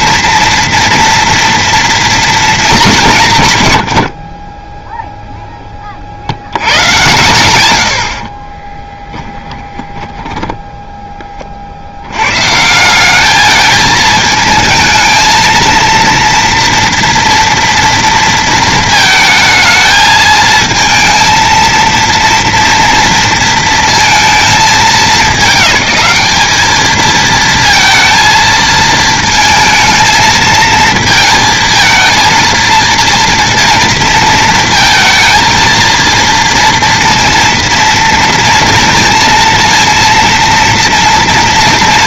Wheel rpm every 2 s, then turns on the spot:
230, 220, 10, 100, 30, 10, 160, 220, 230, 230, 230, 230, 220, 210, 220, 230, 230, 230, 230, 230, 230.
8-12